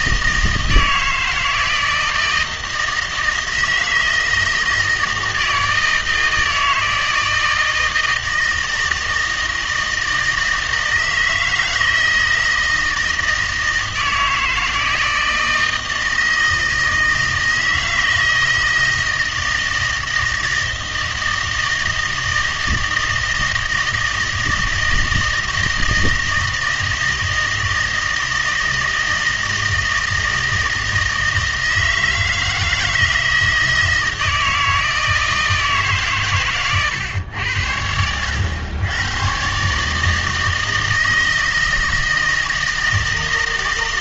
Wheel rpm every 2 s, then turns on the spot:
160, 160, 160, 160, 160, 160, 160, 160, 160, 160, 160, 160, 160, 160, 160, 160, 160, 160, 120, 100, 160, 160.
none